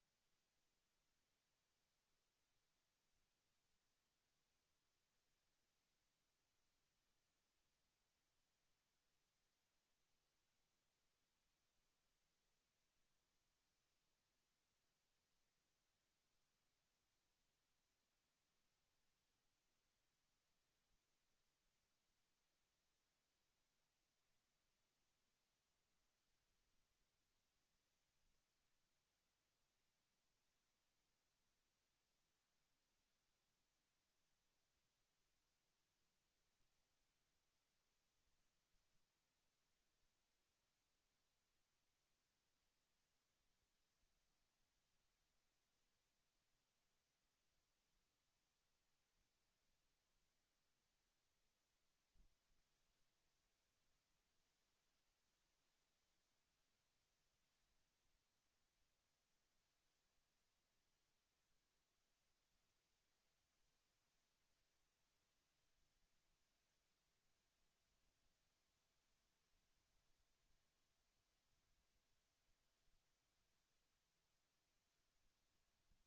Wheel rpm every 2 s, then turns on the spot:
0, 0, 0, 0, 0, 0, 0, 0, 0, 0, 0, 0, 0, 0, 0, 0, 0, 0, 0, 0, 0, 0, 0, 0, 0, 0, 0, 0, 0, 0, 0, 0, 0, 0, 0, 0, 0, 0.
none